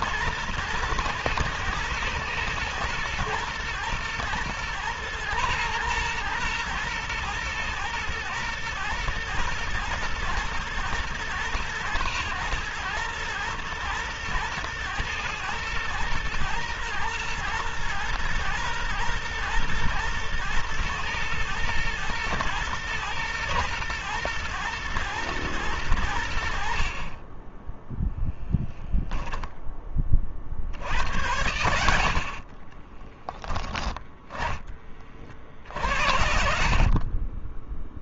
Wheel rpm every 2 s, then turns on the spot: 110, 110, 110, 120, 110, 110, 110, 110, 110, 120, 110, 110, 110, 30, 10, 90, 10, 40, 40.
32-38